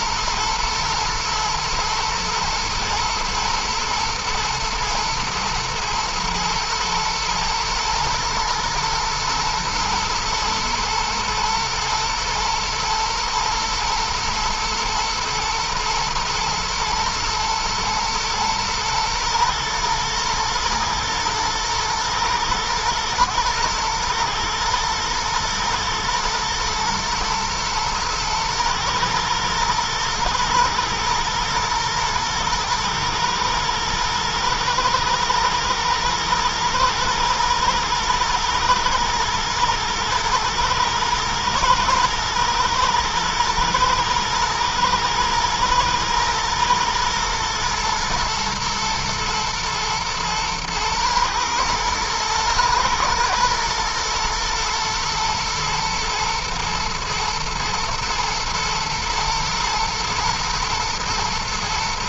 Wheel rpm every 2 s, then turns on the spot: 110, 110, 110, 110, 110, 120, 120, 110, 110, 110, 110, 120, 120, 120, 110, 110, 110, 120, 120, 110, 110, 120, 110, 120, 110, 110, 110, 120, 120, 120, 120.
none